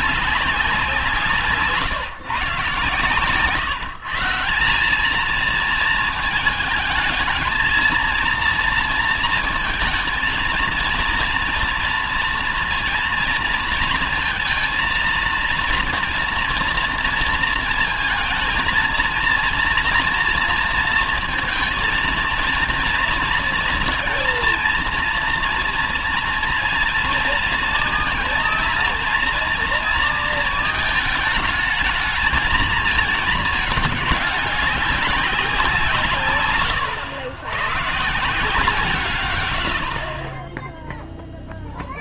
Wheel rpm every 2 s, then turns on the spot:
180, 130, 180, 220, 230, 230, 230, 230, 230, 230, 230, 230, 230, 230, 230, 220, 220, 200, 130, 160, 20.
none